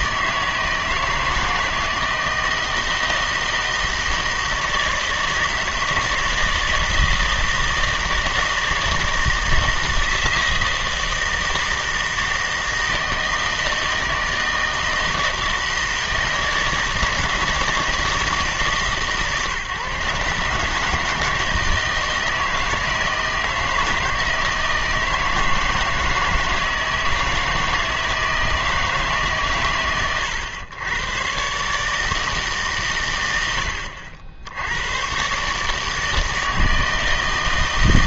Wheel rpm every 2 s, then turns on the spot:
160, 160, 160, 160, 160, 160, 160, 160, 160, 150, 150, 160, 160, 160, 160, 110, 140, 100, 160.
none